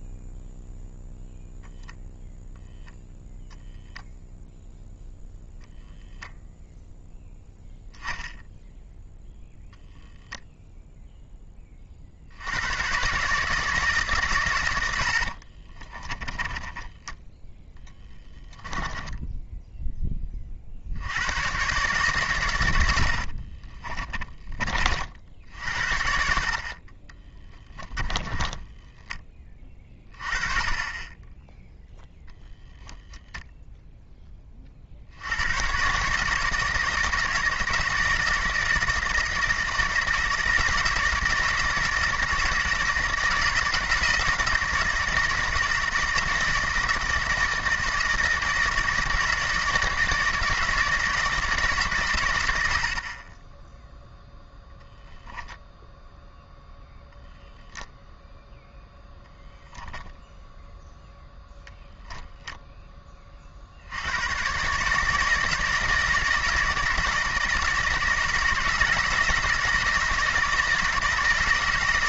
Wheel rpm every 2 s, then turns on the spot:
0, 10, 0, 0, 0, 0, 90, 110, 20, 10, 50, 100, 30, 50, 10, 30, 10, 30, 160, 160, 160, 160, 170, 160, 160, 160, 80, 0, 0, 0, 0, 0, 140, 160, 160, 160.
16-18 28-30